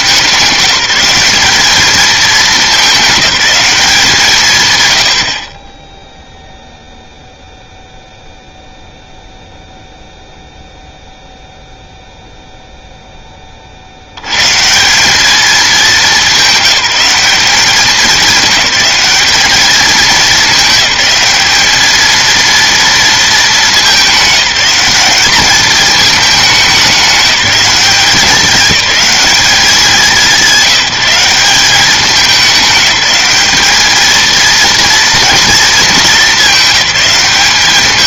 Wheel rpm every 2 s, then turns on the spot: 180, 210, 120, 0, 0, 0, 10, 190, 200, 210, 210, 230, 200, 200, 200, 170, 200, 230, 190.
none